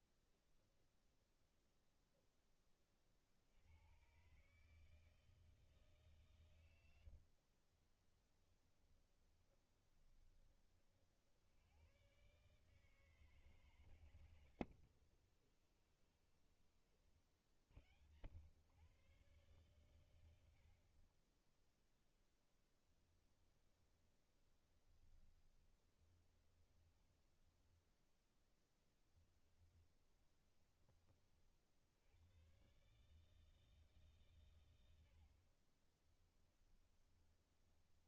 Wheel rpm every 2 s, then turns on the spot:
0, 30, 150, 110, 20, 40, 150, 80, 30, 110, 60, 10, 20, 20, 20, 20, 130, 100, 20.
6-10 14-16 22-30 36-38